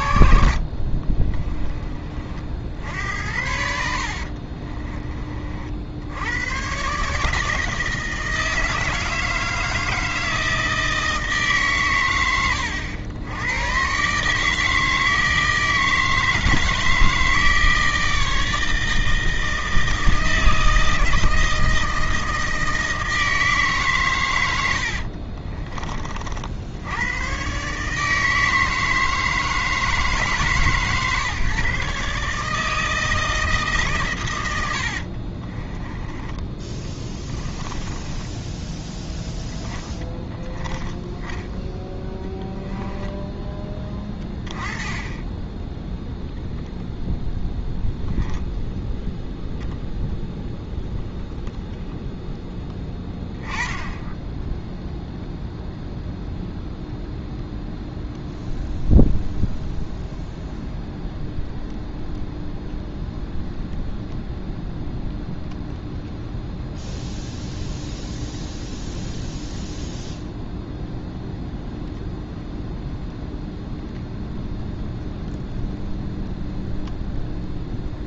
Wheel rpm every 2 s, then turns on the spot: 40, 70, 30, 140, 160, 160, 100, 160, 160, 160, 160, 160, 60, 100, 160, 130, 160, 70, 20, 10, 10, 10, 20, 0, 0, 0, 10, 0, 0, 0, 0, 0, 0, 0, 0, 0, 0, 0, 0.
0-2 24-26 34-38 42-44